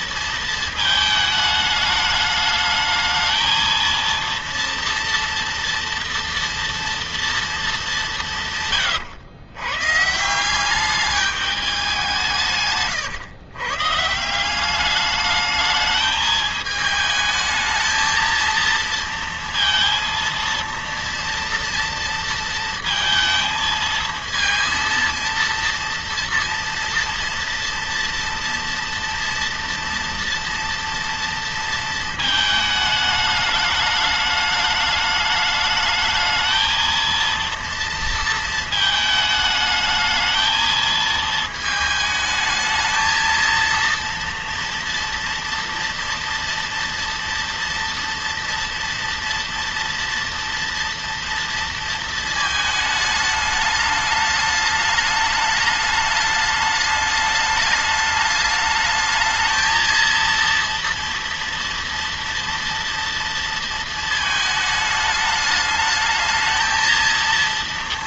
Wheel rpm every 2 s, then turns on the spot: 220, 210, 230, 230, 150, 180, 150, 180, 220, 230, 230, 230, 230, 230, 230, 230, 220, 210, 220, 220, 220, 220, 230, 230, 230, 230, 220, 210, 210, 210, 230, 230, 220, 220.
8-10 12-14